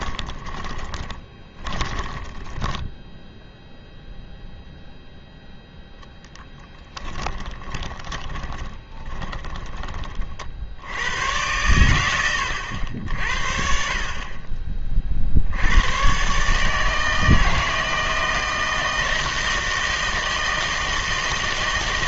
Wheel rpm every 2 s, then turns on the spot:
20, 20, 0, 10, 20, 60, 80, 30, 150, 160, 160.
0-4 6-10